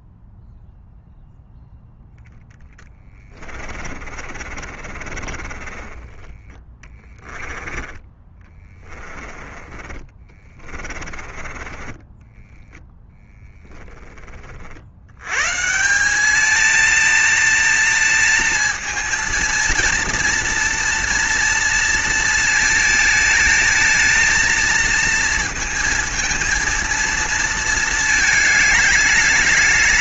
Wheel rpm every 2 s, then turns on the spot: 0, 10, 50, 20, 20, 30, 10, 60, 230, 230, 230, 230, 230, 230, 210.
2-14